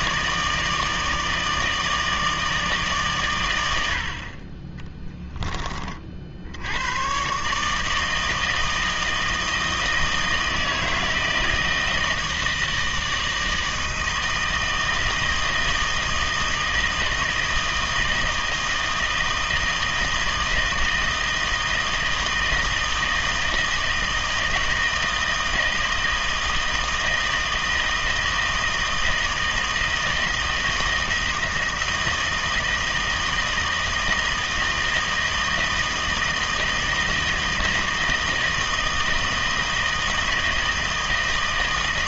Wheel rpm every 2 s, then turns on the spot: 160, 150, 20, 100, 160, 160, 160, 160, 160, 160, 160, 160, 160, 160, 160, 160, 160, 160, 160, 160, 160.
none